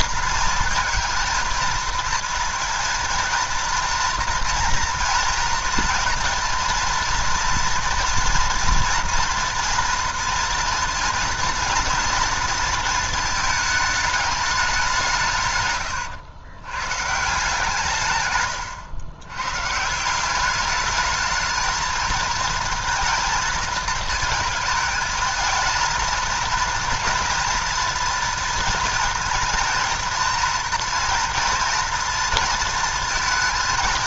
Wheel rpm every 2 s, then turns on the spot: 230, 230, 230, 230, 230, 230, 230, 200, 120, 120, 210, 230, 220, 230, 230, 230, 230.
none